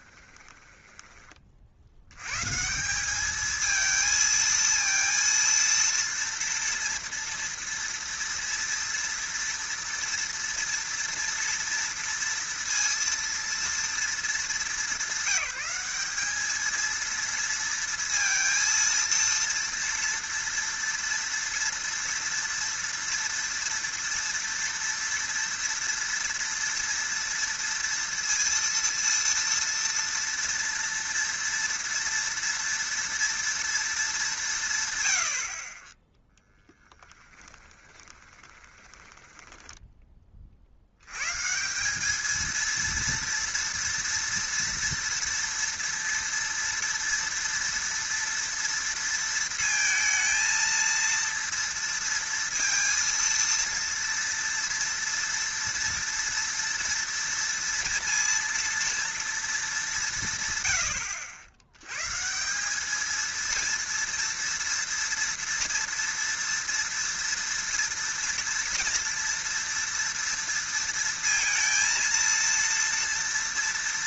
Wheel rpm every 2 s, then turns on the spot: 20, 160, 230, 230, 230, 230, 230, 200, 220, 230, 230, 230, 230, 230, 230, 230, 230, 140, 10, 20, 60, 230, 230, 230, 230, 230, 230, 230, 230, 230, 110, 190, 230, 230, 230, 230, 230.
0-2 38-40